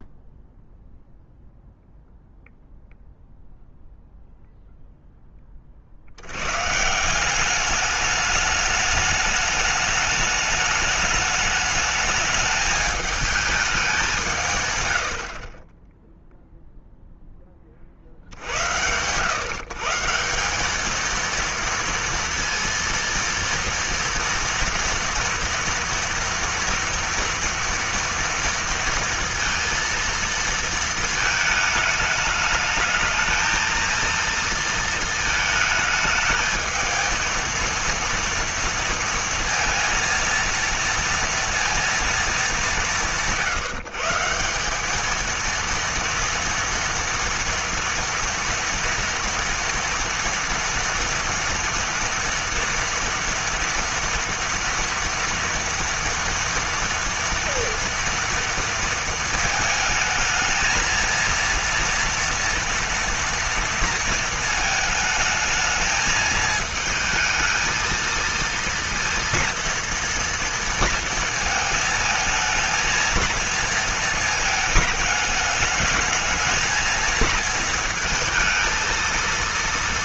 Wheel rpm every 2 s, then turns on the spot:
0, 0, 0, 110, 210, 210, 210, 140, 0, 80, 190, 230, 230, 230, 230, 220, 220, 230, 220, 230, 230, 190, 180, 230, 230, 230, 240, 230, 230, 230, 220, 230, 220, 220, 230, 230, 230, 220, 220, 220.
none